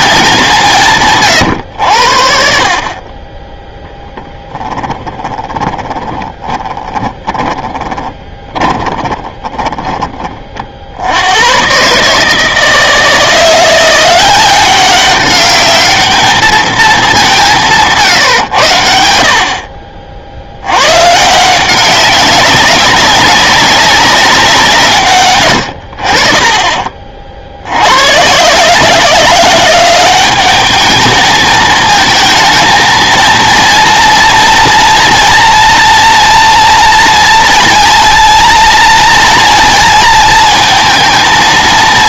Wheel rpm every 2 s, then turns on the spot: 160, 50, 10, 20, 20, 60, 160, 190, 210, 110, 80, 200, 160, 40, 150, 210, 230, 230, 230, 230, 230.
4-10